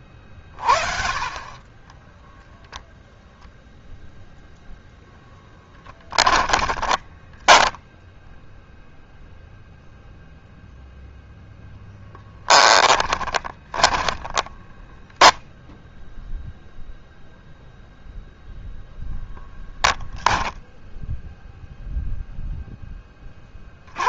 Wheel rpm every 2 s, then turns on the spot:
0, 0, 10, 0, 0, 0, 20, 10, 0, 0, 0, 20.
4-6 12-16